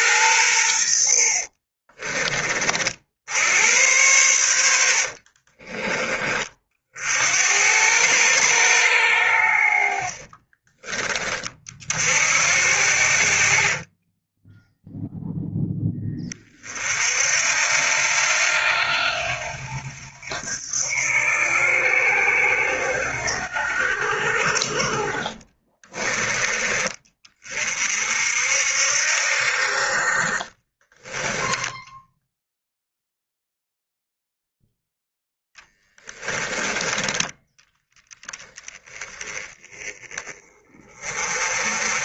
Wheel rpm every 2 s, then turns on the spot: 80, 60, 70, 60, 100, 30, 60, 0, 50, 80, 80, 80, 50, 30, 60, 20, 0, 0, 10, 20, 30.
0-2 4-6